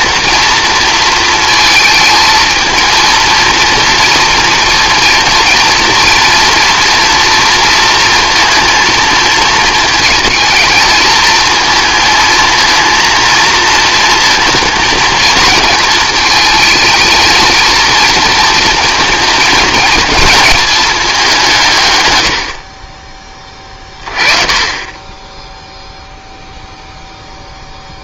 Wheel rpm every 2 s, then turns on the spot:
230, 220, 230, 230, 230, 220, 230, 230, 220, 230, 220, 40, 20, 0.
none